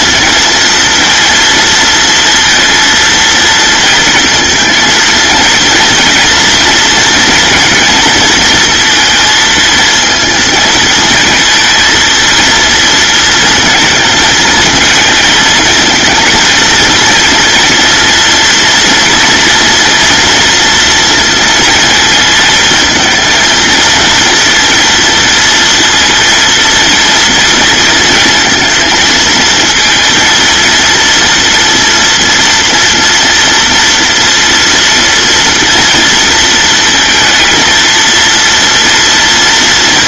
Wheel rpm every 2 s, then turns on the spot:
230, 230, 230, 230, 230, 230, 220, 220, 230, 230, 230, 220, 230, 230, 230, 230, 230, 230, 230, 230.
none